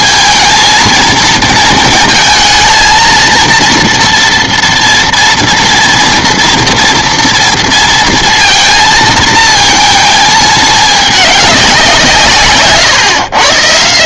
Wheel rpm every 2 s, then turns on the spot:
230, 230, 230, 230, 230, 210, 130.
none